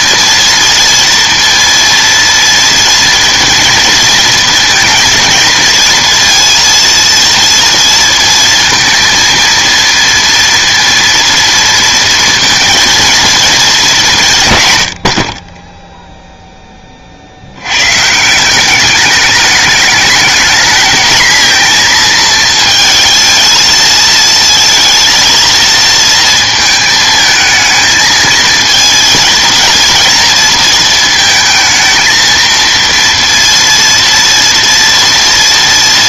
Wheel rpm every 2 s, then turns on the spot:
230, 230, 230, 230, 230, 230, 230, 120, 10, 180, 220, 230, 230, 220, 220, 230, 230, 230.
none